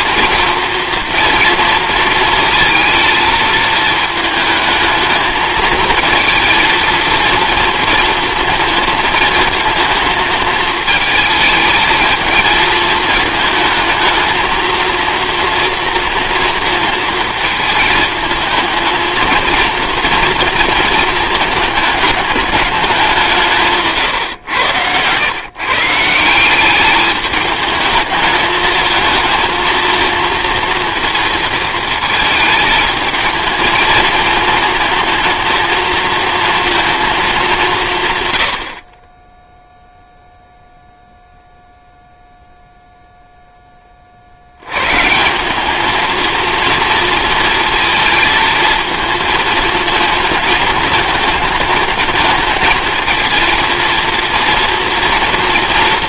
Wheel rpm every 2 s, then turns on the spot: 230, 220, 220, 230, 220, 220, 220, 230, 230, 220, 230, 200, 100, 200, 220, 230, 220, 220, 230, 50, 0, 0, 100, 230, 220, 220, 220, 230.
none